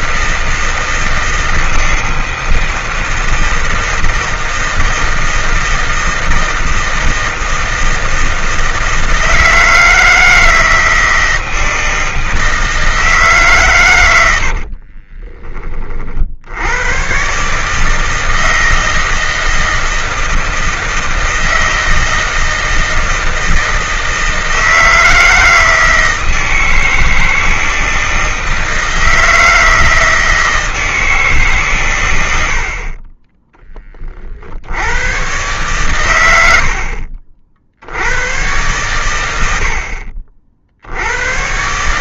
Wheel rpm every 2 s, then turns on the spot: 160, 160, 160, 160, 160, 160, 160, 70, 70, 160, 160, 160, 160, 160, 160, 160, 60, 70, 80, 110, 50.
14-16 36-38